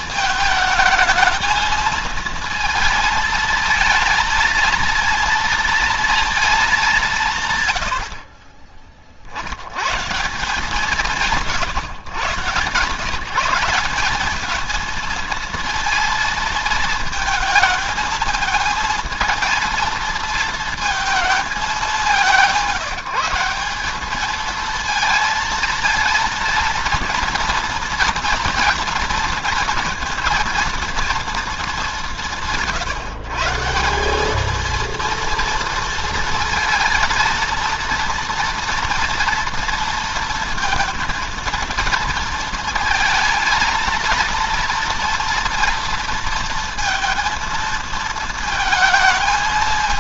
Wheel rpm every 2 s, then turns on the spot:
220, 220, 230, 170, 40, 180, 160, 220, 220, 230, 220, 170, 230, 230, 230, 230, 150, 230, 230, 230, 230, 220, 230, 230, 220.
none